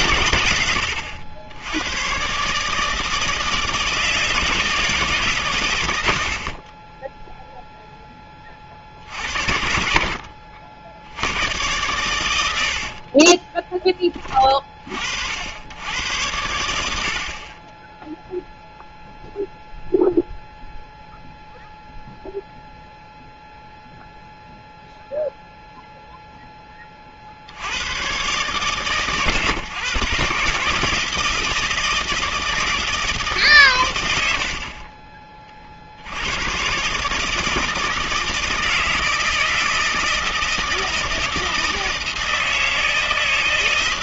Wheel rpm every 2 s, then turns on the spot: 120, 150, 160, 40, 40, 60, 80, 30, 90, 0, 0, 0, 0, 10, 130, 140, 160, 60, 120, 160, 160, 160.
6-8 12-14